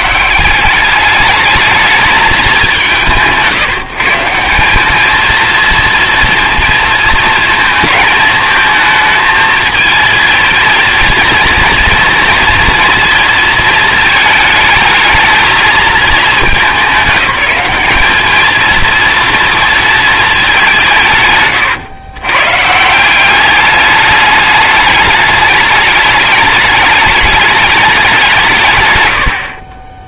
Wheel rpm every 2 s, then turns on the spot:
200, 190, 210, 230, 220, 230, 240, 220, 190, 230, 170, 160, 210, 210, 130.
none